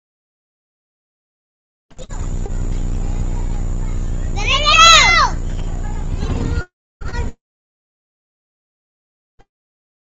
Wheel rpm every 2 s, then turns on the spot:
0, 0, 0, 0, 0.
none